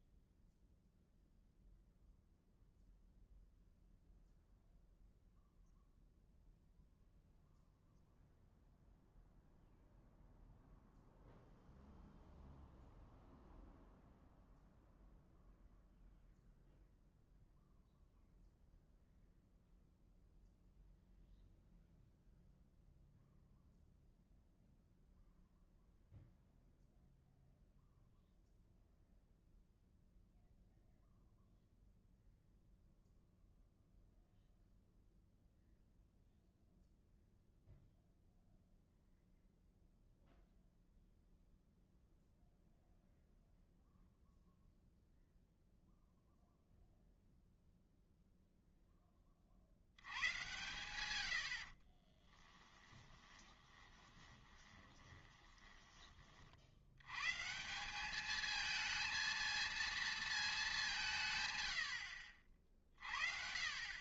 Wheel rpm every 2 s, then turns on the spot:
0, 0, 0, 0, 0, 0, 0, 0, 0, 0, 0, 0, 0, 0, 0, 0, 0, 0, 0, 0, 0, 0, 0, 0, 0, 110, 10, 20, 60, 220, 210, 50.
52-56